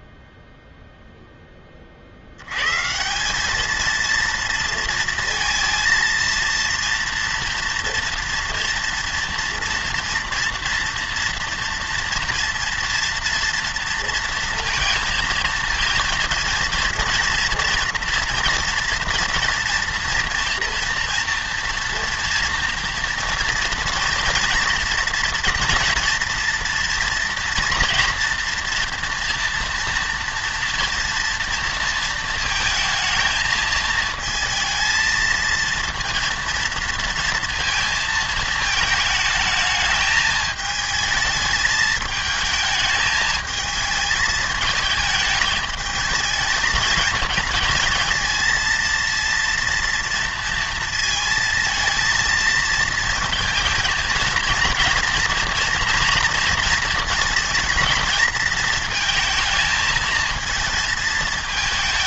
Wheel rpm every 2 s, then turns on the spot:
0, 120, 230, 230, 230, 230, 230, 230, 230, 230, 230, 230, 230, 230, 230, 230, 220, 220, 230, 220, 220, 220, 210, 220, 230, 230, 220, 230, 230, 220, 220.
none